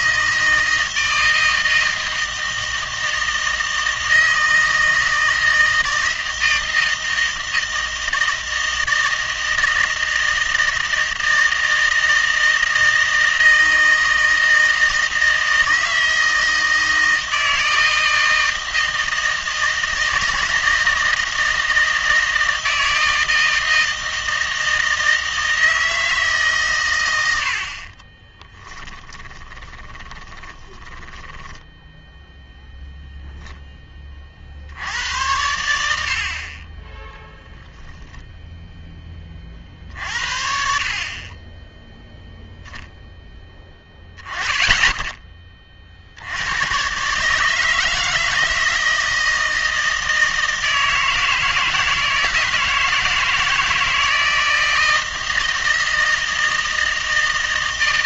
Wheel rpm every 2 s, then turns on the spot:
160, 160, 160, 160, 160, 160, 160, 160, 160, 160, 160, 160, 160, 130, 20, 20, 0, 70, 30, 10, 50, 0, 10, 110, 160, 160, 160, 160, 160.
28-32